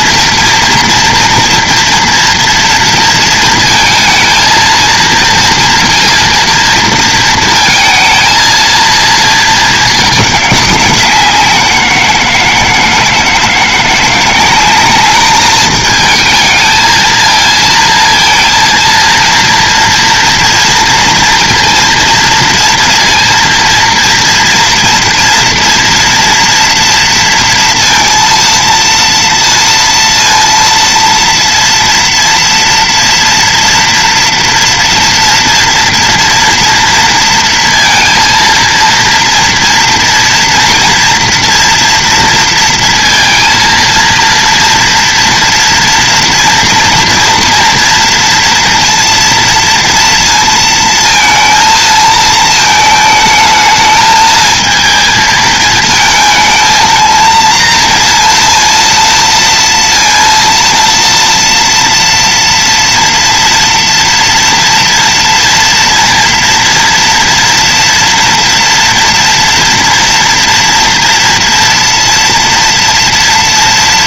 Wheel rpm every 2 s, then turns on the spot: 230, 230, 230, 230, 230, 190, 160, 200, 220, 230, 230, 230, 230, 230, 230, 230, 230, 230, 230, 230, 240, 230, 230, 240, 230, 230, 220, 220, 230, 230, 230, 230, 230, 230, 230, 230, 230.
none